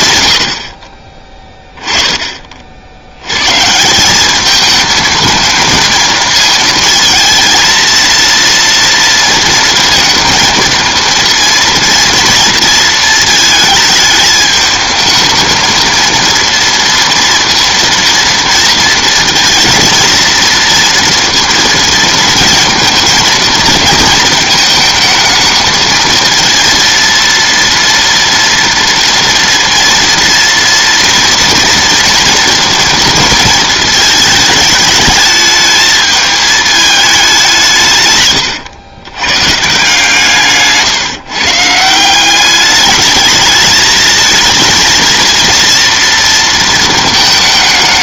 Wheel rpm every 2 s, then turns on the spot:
50, 60, 220, 220, 230, 220, 220, 210, 230, 230, 230, 230, 220, 230, 230, 240, 230, 220, 220, 120, 150, 210, 220, 220.
40-42